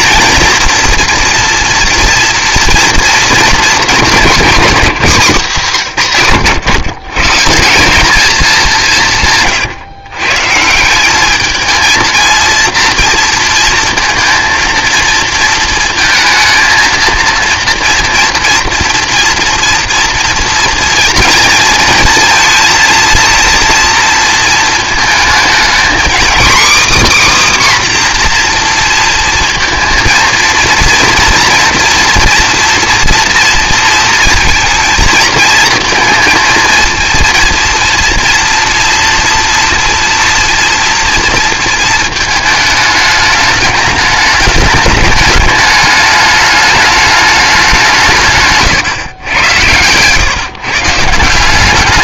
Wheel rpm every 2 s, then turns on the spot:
240, 230, 180, 100, 180, 160, 230, 230, 230, 230, 230, 230, 220, 280, 240, 230, 230, 230, 230, 230, 230, 220, 210, 210, 130, 150.
48-50